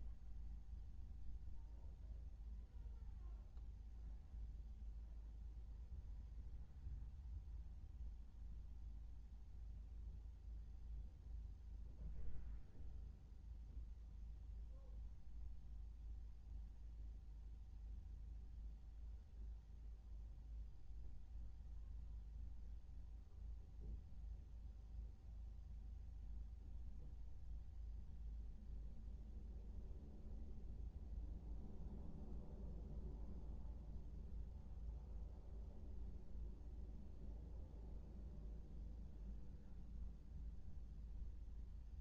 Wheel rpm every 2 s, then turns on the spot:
0, 0, 0, 0, 0, 0, 0, 0, 0, 0, 0, 0, 0, 0, 0, 0, 0, 0, 0, 0, 0.
none